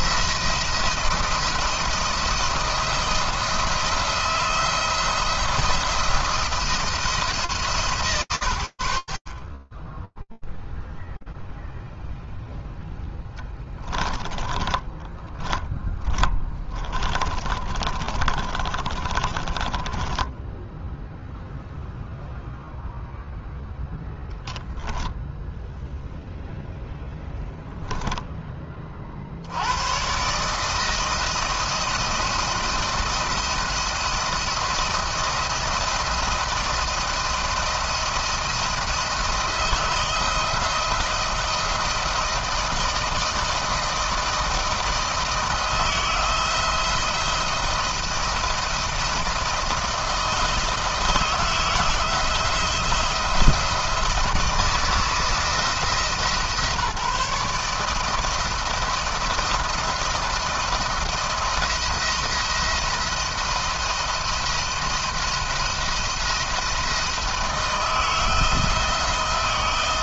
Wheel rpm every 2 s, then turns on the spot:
170, 170, 170, 170, 50, 0, 10, 20, 30, 30, 0, 0, 0, 10, 120, 170, 170, 160, 170, 170, 160, 160, 160, 170, 160, 160, 160, 160, 160, 170, 170, 170, 170, 160, 160.
14-20